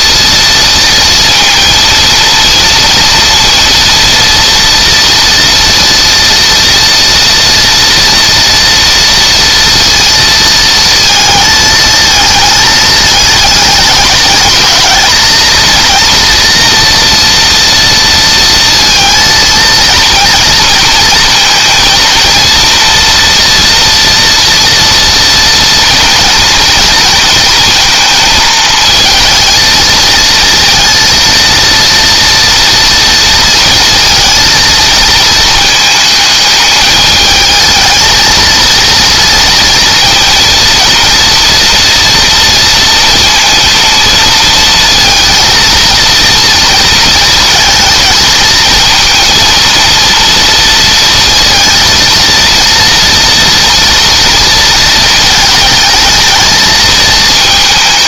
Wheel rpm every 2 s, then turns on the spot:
230, 230, 230, 230, 230, 220, 210, 220, 230, 230, 230, 230, 230, 230, 220, 230, 230, 220, 220, 230, 230, 230, 230, 230, 230, 230, 230, 220, 220.
none